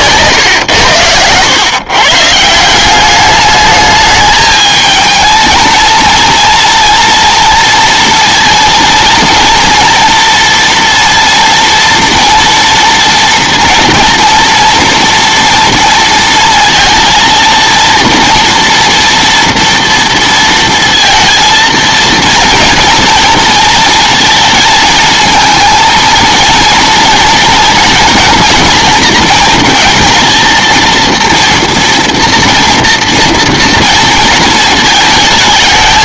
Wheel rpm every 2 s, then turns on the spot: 100, 190, 220, 230, 230, 240, 240, 230, 230, 230, 230, 230, 220, 230, 230, 230, 230, 220.
none